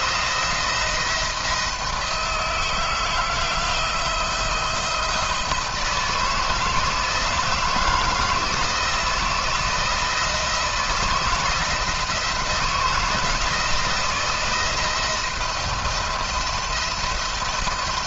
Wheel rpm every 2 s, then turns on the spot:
160, 160, 170, 170, 170, 160, 160, 170, 170.
none